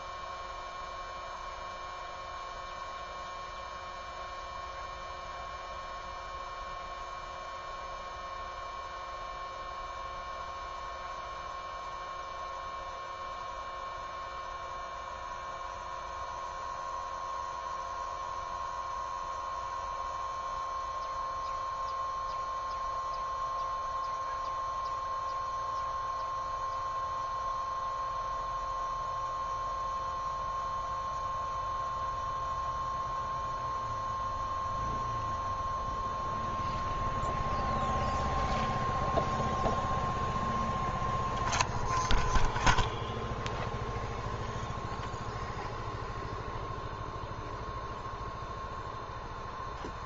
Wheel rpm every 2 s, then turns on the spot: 0, 0, 0, 0, 0, 0, 0, 0, 0, 0, 0, 0, 0, 0, 0, 0, 0, 0, 0, 0, 0, 0, 0, 0, 0.
none